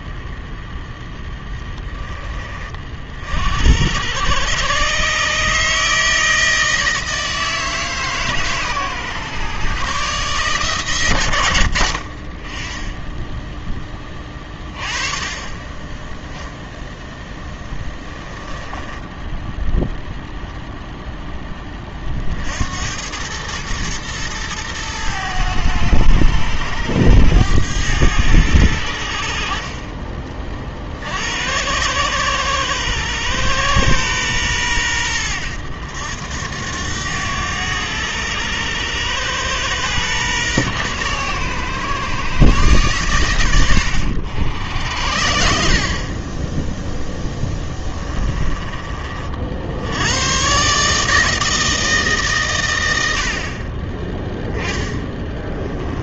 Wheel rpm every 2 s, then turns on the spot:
0, 30, 120, 160, 130, 130, 20, 20, 0, 10, 0, 80, 110, 100, 90, 50, 110, 110, 90, 100, 120, 120, 70, 10, 30, 140, 110, 10.
18-20 48-50 54-56